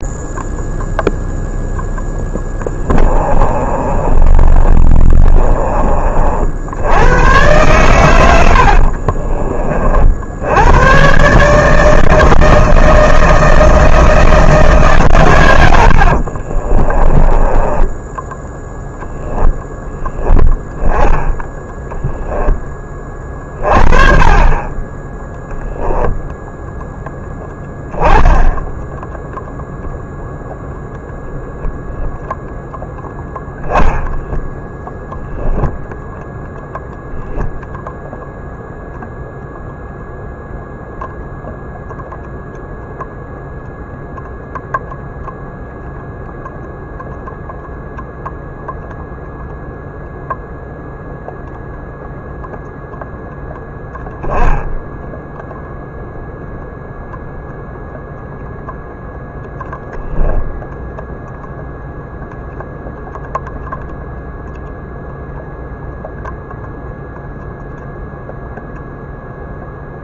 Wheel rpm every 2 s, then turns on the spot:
0, 20, 30, 80, 70, 100, 160, 150, 30, 10, 10, 20, 20, 0, 10, 0, 0, 0, 0, 0, 0, 0, 0, 0, 0, 0, 0, 0, 0, 0, 0, 0, 0, 0, 0.
2-6 8-10 16-18